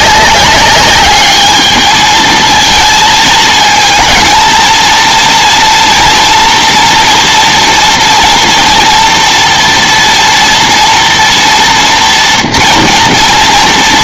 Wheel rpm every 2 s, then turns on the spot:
200, 230, 230, 230, 230, 240, 230.
none